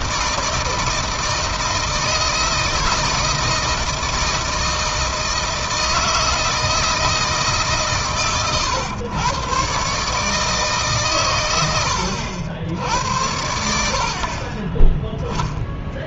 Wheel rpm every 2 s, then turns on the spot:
160, 160, 160, 160, 110, 140, 80, 20.
none